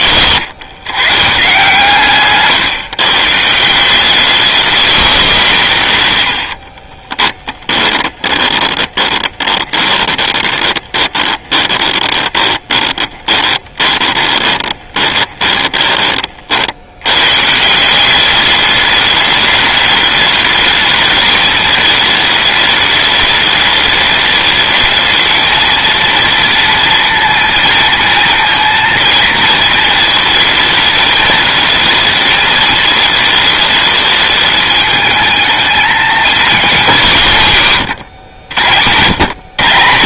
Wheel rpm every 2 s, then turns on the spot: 130, 140, 210, 40, 20, 20, 10, 20, 80, 210, 210, 210, 220, 230, 230, 220, 220, 220, 190, 100.
6-16